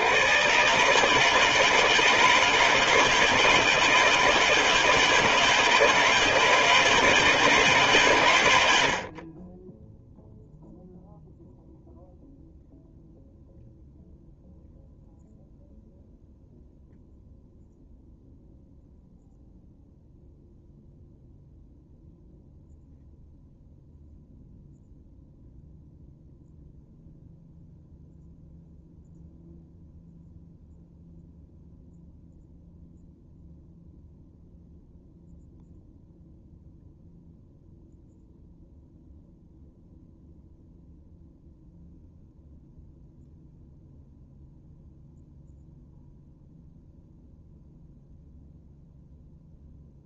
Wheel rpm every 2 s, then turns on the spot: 140, 160, 160, 160, 70, 0, 0, 0, 0, 0, 0, 0, 0, 0, 0, 0, 0, 0, 0, 0, 0, 0, 0, 0, 0.
none